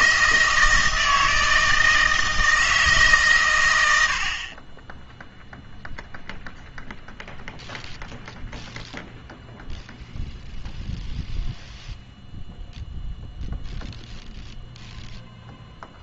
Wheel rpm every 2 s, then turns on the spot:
160, 160, 20, 0, 0, 0, 0, 0.
none